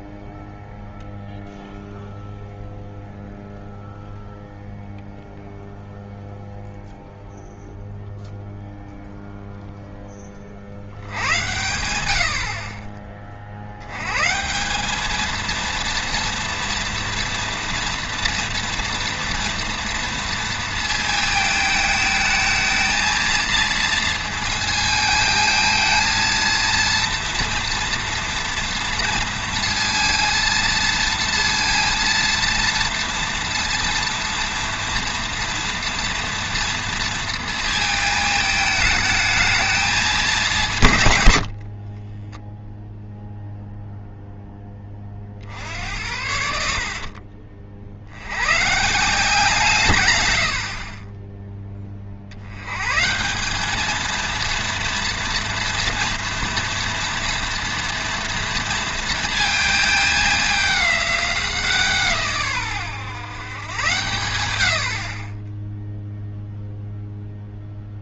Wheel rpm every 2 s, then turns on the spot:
0, 0, 0, 0, 0, 60, 40, 180, 230, 230, 230, 220, 220, 230, 230, 230, 230, 230, 230, 220, 170, 10, 10, 70, 130, 60, 110, 230, 230, 230, 210, 130, 80, 0.
46-48 50-52